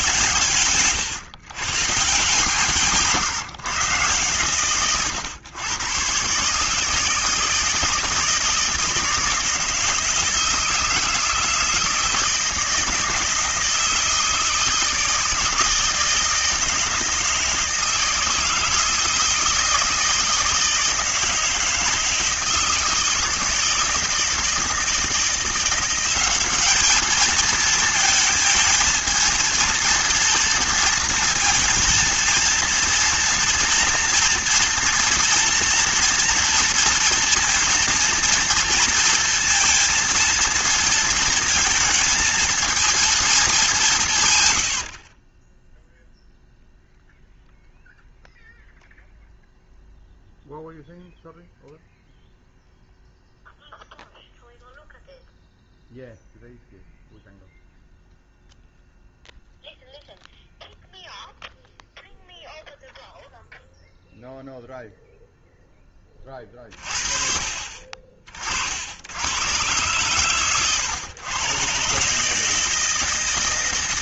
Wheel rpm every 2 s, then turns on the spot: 110, 160, 110, 150, 170, 160, 160, 160, 160, 160, 160, 160, 160, 210, 220, 230, 230, 230, 230, 230, 230, 230, 90, 0, 0, 0, 0, 0, 0, 0, 0, 0, 0, 40, 60, 110, 160.
0-2